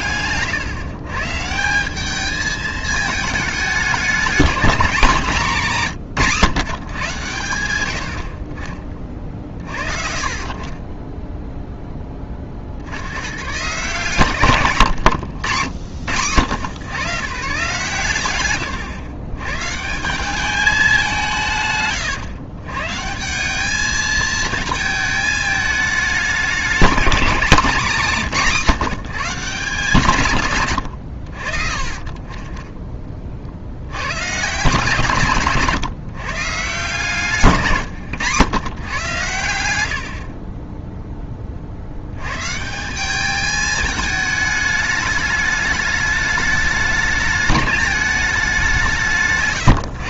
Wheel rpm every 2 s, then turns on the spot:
130, 220, 220, 140, 40, 30, 40, 130, 100, 110, 210, 130, 220, 210, 190, 120, 20, 140, 150, 120, 20, 140, 210, 210, 180.
40-42